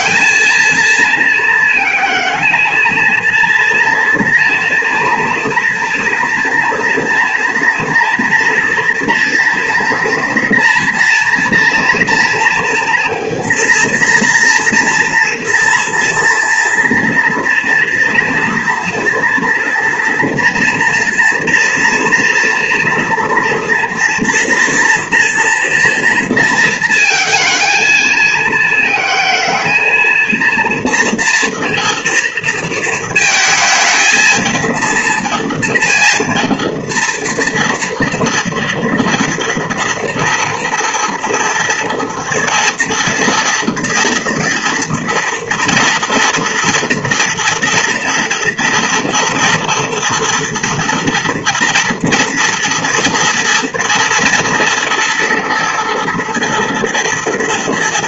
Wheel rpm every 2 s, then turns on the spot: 230, 230, 230, 240, 230, 230, 230, 230, 230, 230, 230, 230, 230, 230, 220, 230, 220, 230, 230, 230, 230, 230, 230, 230, 230, 230, 240, 230, 240.
none